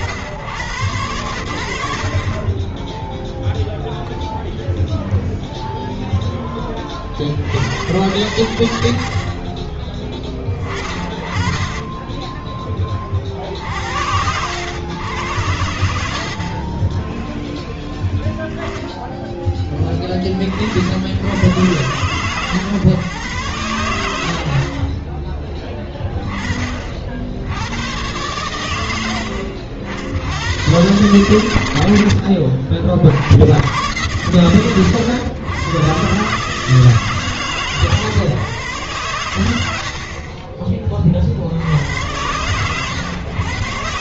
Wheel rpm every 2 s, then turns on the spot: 90, 20, 0, 20, 80, 20, 20, 90, 40, 10, 50, 140, 30, 40, 100, 110, 60, 100, 150, 120, 30, 110.
none